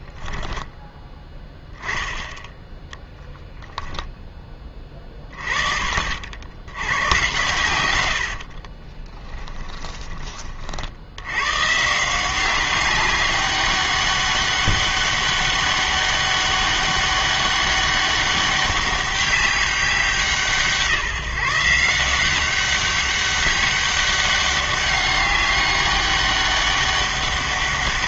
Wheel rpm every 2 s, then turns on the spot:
10, 10, 20, 90, 40, 50, 190, 200, 200, 200, 150, 190, 200, 200.
8-10